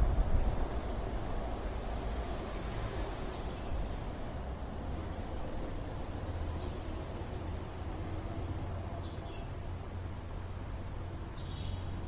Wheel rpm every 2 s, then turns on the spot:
0, 0, 0, 0, 0, 0.
none